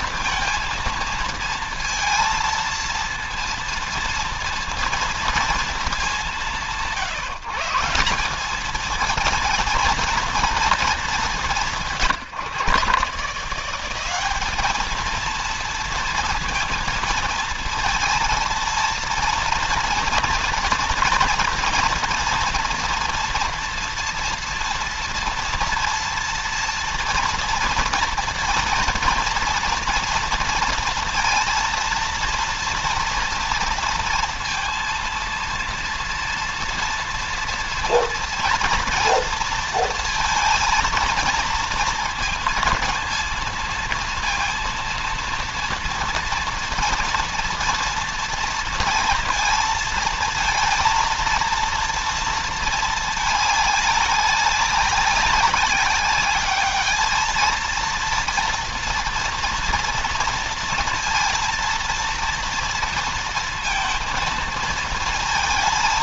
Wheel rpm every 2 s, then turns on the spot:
230, 230, 230, 160, 220, 210, 160, 220, 230, 230, 230, 230, 230, 230, 230, 230, 230, 230, 230, 230, 230, 230, 230, 230, 230, 230, 220, 200, 210, 230, 230, 230, 230.
none